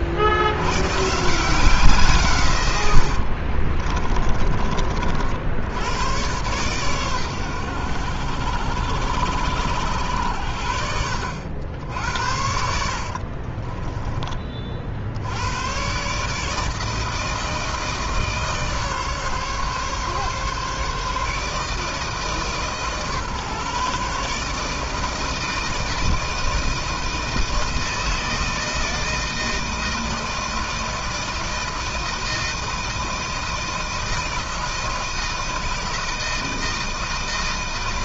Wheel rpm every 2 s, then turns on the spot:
100, 110, 30, 120, 80, 70, 60, 50, 150, 150, 150, 150, 150, 160, 160, 160, 160, 160, 160.
12-14